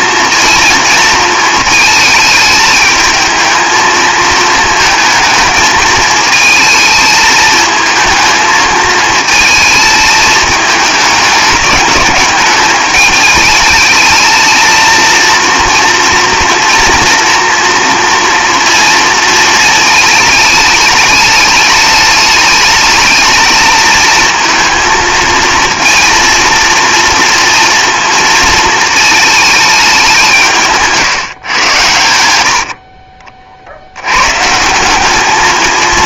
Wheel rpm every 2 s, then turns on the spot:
230, 220, 230, 220, 220, 210, 200, 220, 230, 230, 210, 210, 220, 230, 220, 160, 70, 160.
none